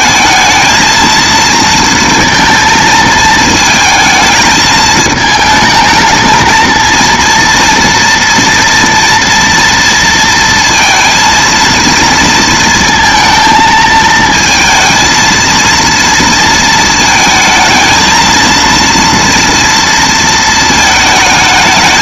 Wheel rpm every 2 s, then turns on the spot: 220, 230, 220, 230, 230, 230, 230, 230, 230, 230, 220.
none